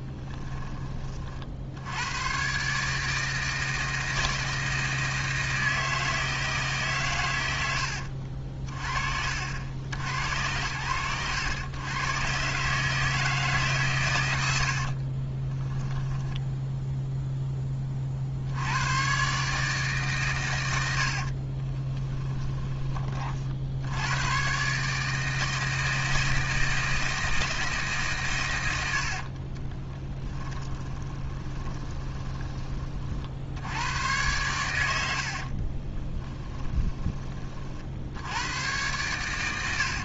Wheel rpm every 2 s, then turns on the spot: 30, 150, 160, 140, 40, 80, 150, 40, 0, 110, 80, 30, 140, 160, 70, 10, 40, 80, 20, 100.
14-16 20-22 28-32